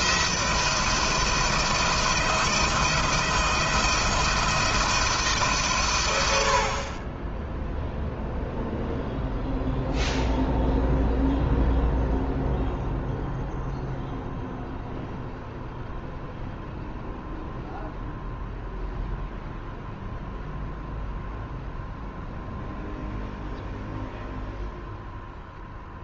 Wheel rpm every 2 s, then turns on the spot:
170, 170, 160, 50, 0, 0, 0, 0, 0, 0, 0, 0, 0.
none